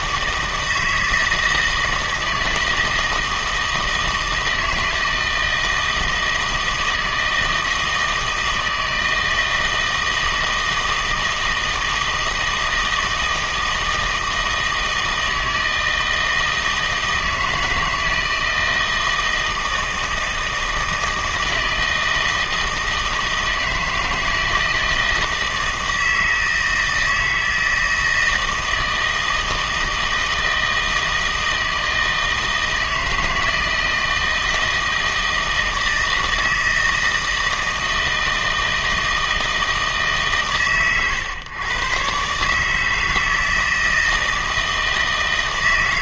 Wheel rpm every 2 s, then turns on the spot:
160, 160, 160, 160, 160, 160, 160, 160, 160, 160, 160, 160, 160, 160, 160, 160, 160, 160, 160, 160, 130, 150, 160.
none